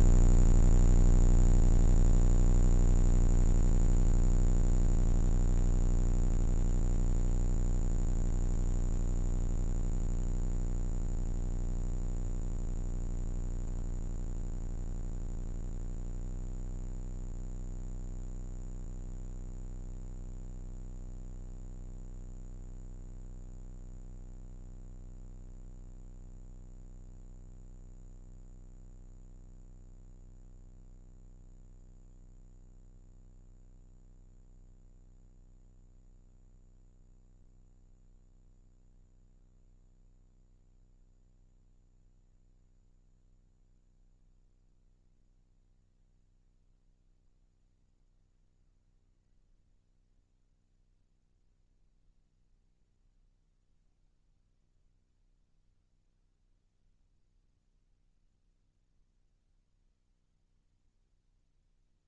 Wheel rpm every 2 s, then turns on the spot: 10, 20, 140, 160, 160, 160, 140, 10, 0, 0, 0, 0, 0, 0, 0, 0, 0, 0, 0, 0, 0, 0, 0, 0, 0, 0, 0, 0, 0, 0, 0.
0-2